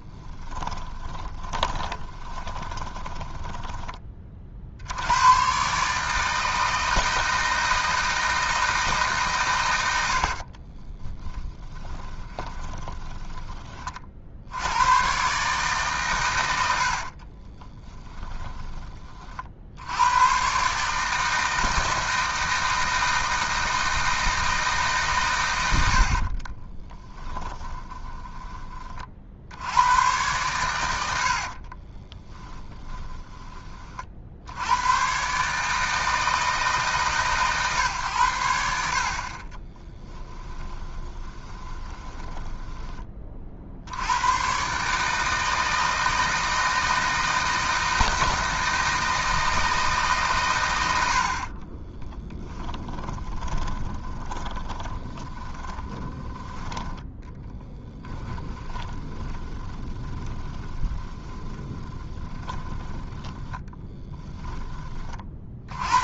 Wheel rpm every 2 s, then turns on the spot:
10, 20, 80, 160, 160, 30, 20, 100, 80, 20, 150, 160, 150, 20, 30, 100, 20, 100, 150, 60, 20, 20, 140, 160, 160, 90, 20, 10, 20, 20, 20, 10, 30.
0-4 10-14 16-18 26-28 32-34 40-42 52-56 58-64